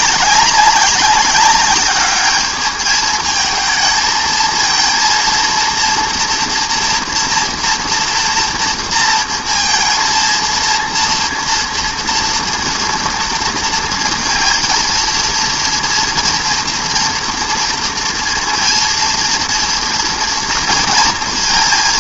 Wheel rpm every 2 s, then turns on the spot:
200, 210, 220, 240, 230, 230, 230, 230, 230, 230, 230.
none